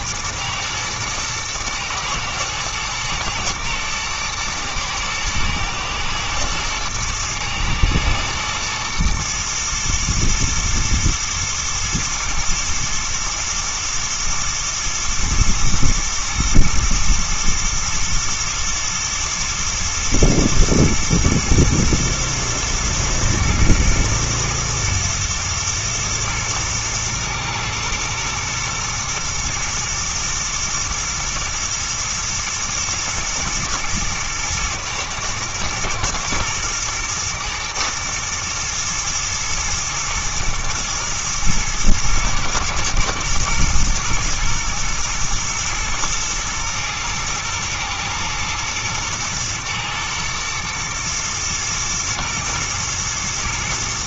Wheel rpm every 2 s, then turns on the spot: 120, 110, 120, 110, 110, 120, 120, 120, 110, 110, 120, 120, 110, 110, 120, 110, 110, 110, 120, 120, 110, 120, 120, 110, 110, 120, 120.
none